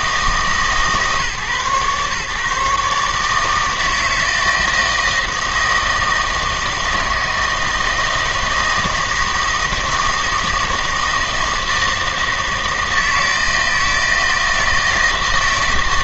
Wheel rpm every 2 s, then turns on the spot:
150, 140, 160, 160, 160, 160, 160, 160.
none